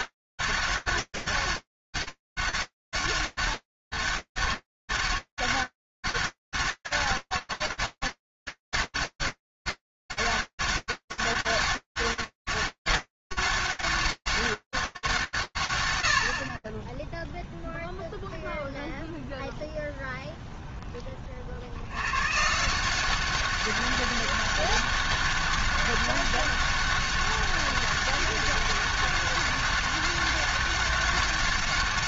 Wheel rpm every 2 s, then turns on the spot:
200, 200, 200, 200, 200, 200, 200, 200, 90, 0, 10, 170, 200, 200, 200, 200.
none